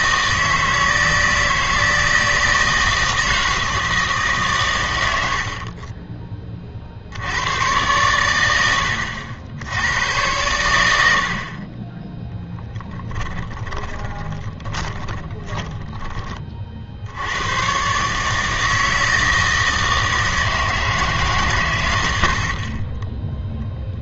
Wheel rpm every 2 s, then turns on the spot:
160, 160, 120, 40, 90, 90, 10, 10, 50, 160, 160, 40.
12-16